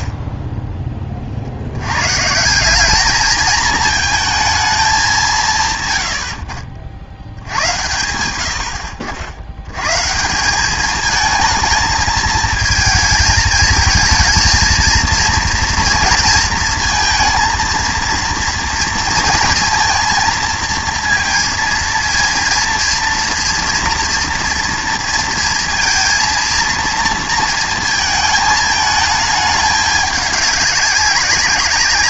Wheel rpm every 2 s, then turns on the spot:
30, 190, 220, 70, 90, 190, 220, 230, 230, 230, 230, 230, 230, 230, 220, 200.
none